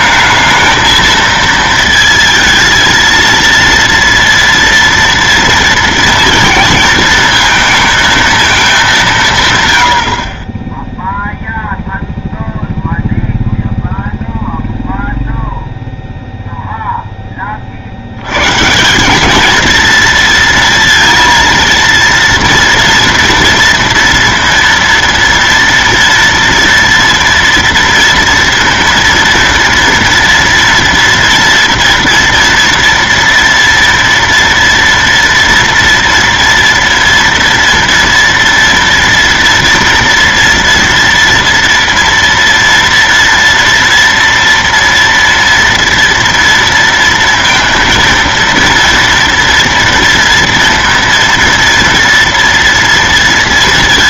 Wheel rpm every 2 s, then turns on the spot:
220, 230, 230, 230, 220, 30, 0, 0, 0, 120, 230, 230, 230, 240, 230, 230, 230, 230, 230, 230, 230, 230, 230, 230, 230, 230, 230.
none